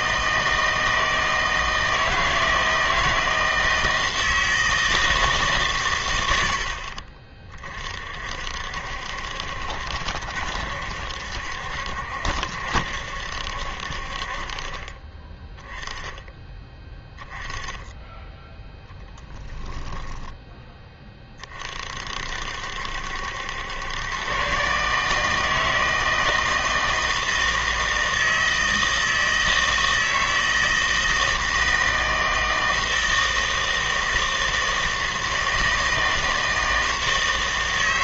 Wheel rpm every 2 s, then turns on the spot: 160, 160, 160, 70, 60, 70, 70, 30, 10, 10, 10, 60, 140, 160, 160, 160, 160, 160, 160.
none